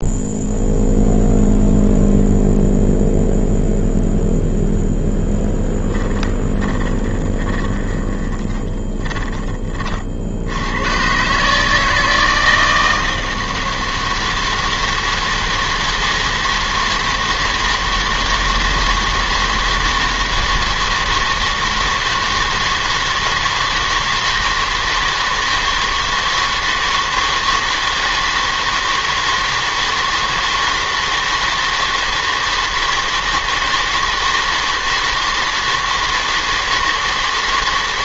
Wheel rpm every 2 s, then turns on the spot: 0, 0, 0, 20, 10, 110, 160, 160, 160, 160, 160, 160, 160, 160, 160, 160, 160, 160, 160.
6-10